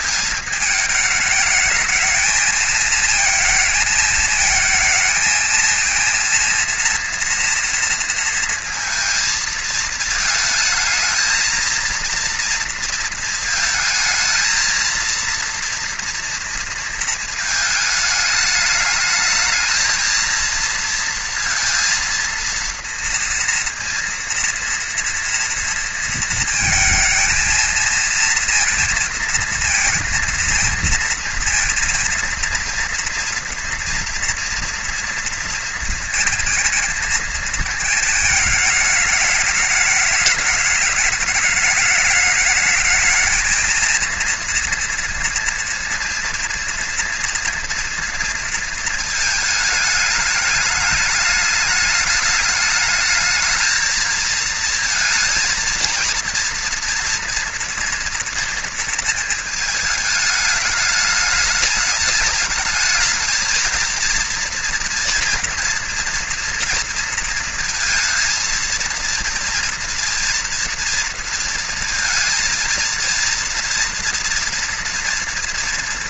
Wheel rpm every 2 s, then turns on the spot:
220, 220, 220, 230, 230, 220, 230, 230, 230, 220, 230, 230, 240, 230, 230, 230, 230, 230, 230, 220, 210, 210, 230, 230, 230, 210, 210, 220, 230, 230, 210, 210, 230, 240, 230, 230, 230, 230.
none